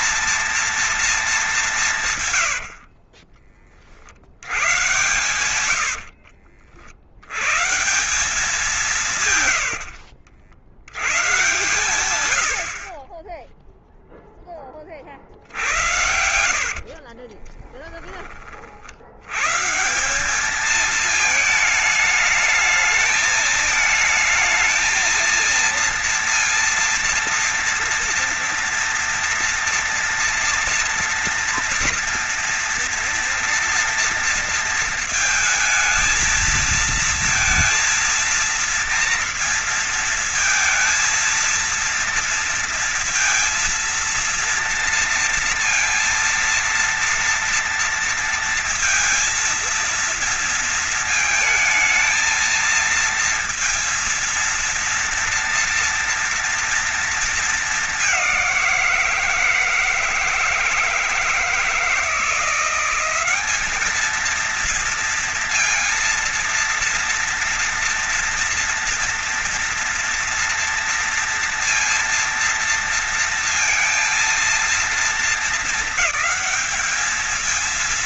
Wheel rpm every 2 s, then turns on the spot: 220, 60, 110, 90, 170, 100, 50, 30, 50, 70, 220, 220, 230, 230, 230, 230, 230, 220, 230, 230, 230, 230, 230, 230, 230, 230, 230, 230, 230, 170, 160, 180, 230, 230, 230, 230, 230, 230, 220.
2-6 8-10 14-18